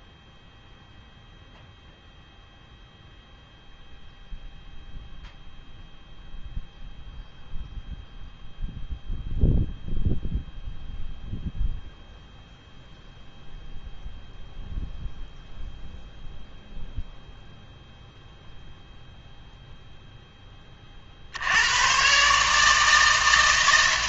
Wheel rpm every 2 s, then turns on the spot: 0, 0, 0, 0, 0, 0, 0, 0, 0, 0, 30, 160.
none